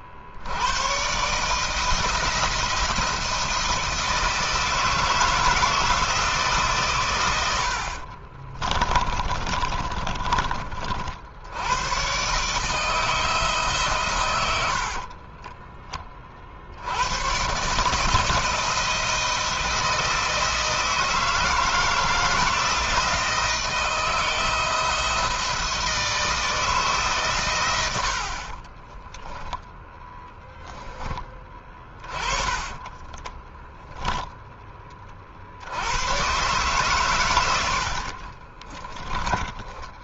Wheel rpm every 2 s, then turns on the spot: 120, 170, 160, 110, 20, 50, 160, 50, 80, 160, 160, 170, 170, 140, 10, 20, 10, 30, 130, 20.
8-10 14-16 28-30 32-34 38-40